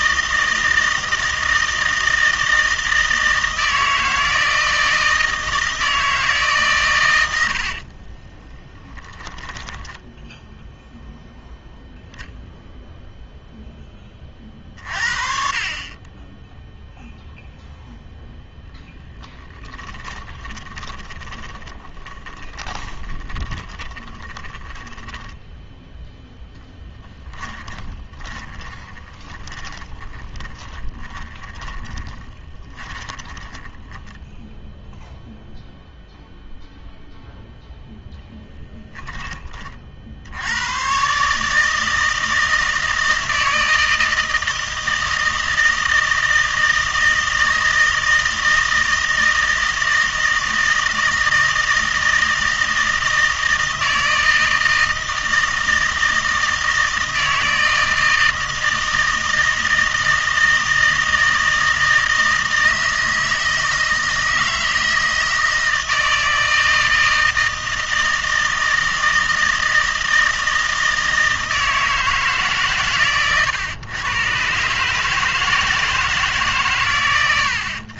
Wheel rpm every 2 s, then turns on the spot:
160, 160, 160, 70, 10, 0, 0, 40, 0, 10, 20, 20, 10, 20, 20, 20, 20, 0, 0, 30, 150, 160, 160, 160, 160, 160, 160, 160, 160, 160, 160, 160, 160, 160, 160, 160, 140, 130, 140.
6-10 18-34